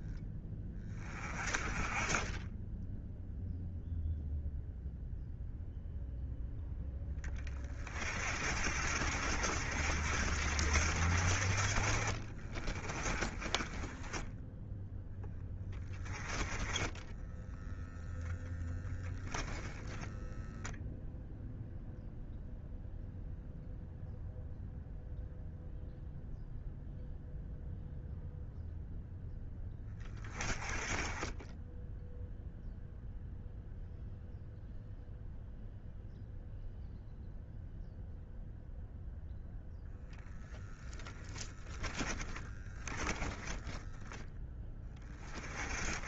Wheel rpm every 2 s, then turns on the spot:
20, 10, 0, 0, 60, 60, 20, 0, 10, 10, 0, 0, 0, 0, 0, 20, 0, 0, 0, 0, 10, 10, 20.
12-14 16-18 42-44